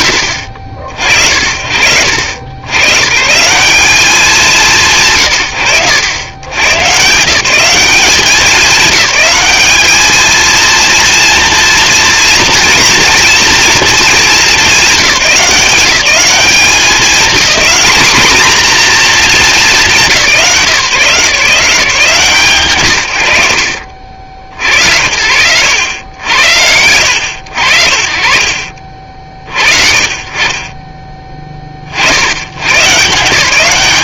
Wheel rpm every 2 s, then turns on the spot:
50, 130, 130, 140, 200, 230, 230, 190, 220, 240, 160, 130, 70, 80, 60, 20, 120.
none